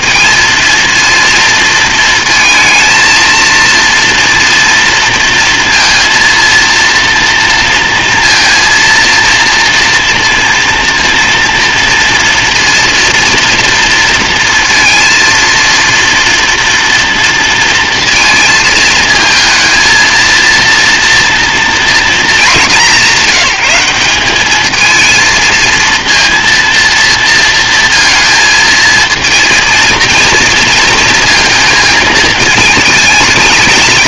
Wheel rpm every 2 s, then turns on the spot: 230, 230, 230, 230, 230, 230, 230, 230, 230, 230, 230, 220, 200, 230, 230, 230, 220.
none